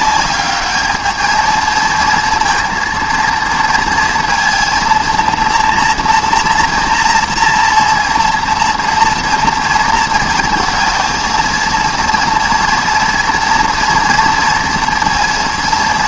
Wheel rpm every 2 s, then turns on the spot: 210, 230, 230, 230, 230, 220, 230, 230.
none